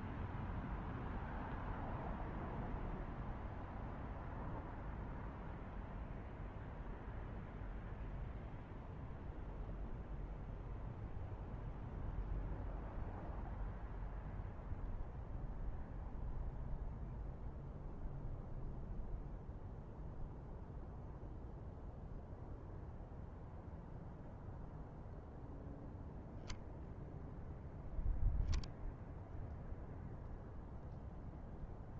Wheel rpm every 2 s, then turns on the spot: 0, 0, 0, 0, 0, 0, 0, 0, 0, 0, 0, 0, 0, 0, 0, 0.
none